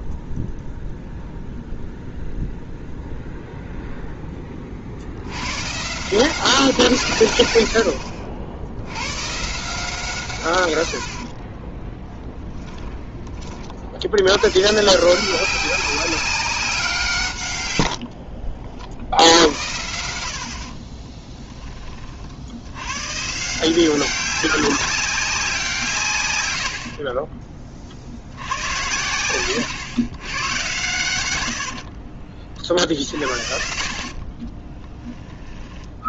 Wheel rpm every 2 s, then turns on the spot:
0, 0, 30, 170, 80, 110, 10, 120, 190, 60, 50, 80, 190, 90, 90, 100, 40, 20.
12-14 34-36